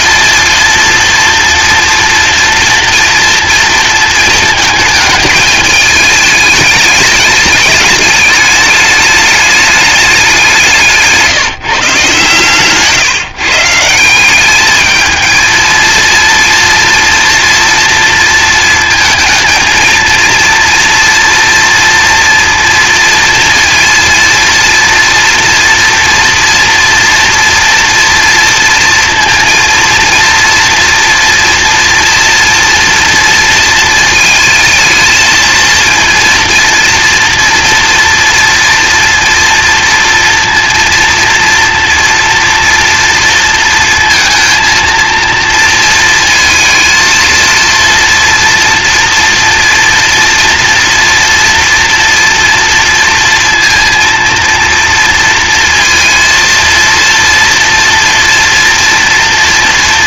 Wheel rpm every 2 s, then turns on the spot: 230, 230, 220, 210, 210, 180, 140, 200, 230, 230, 240, 230, 230, 230, 230, 230, 230, 220, 230, 230, 230, 230, 230, 230, 230, 230, 230, 230, 230, 230.
none